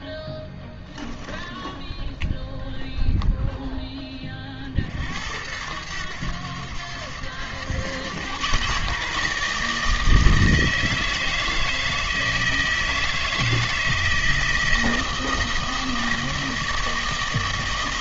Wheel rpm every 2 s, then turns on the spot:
10, 0, 40, 90, 120, 160, 160, 160, 160.
0-2